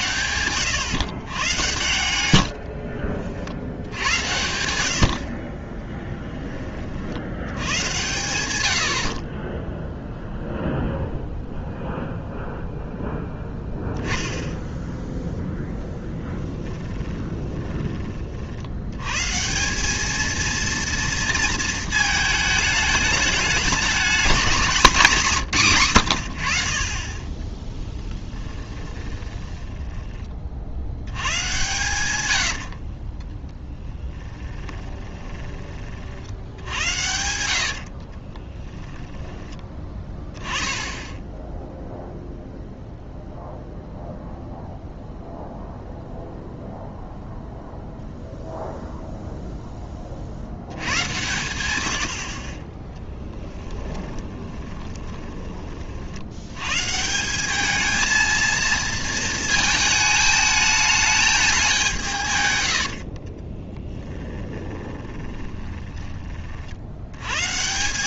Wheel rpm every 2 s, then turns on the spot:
120, 50, 80, 20, 70, 0, 0, 10, 20, 90, 230, 210, 200, 60, 20, 70, 60, 10, 80, 10, 10, 0, 0, 0, 0, 90, 20, 20, 120, 230, 220, 110, 30, 60.
2-4 16-18 28-30 32-40 54-56 62-66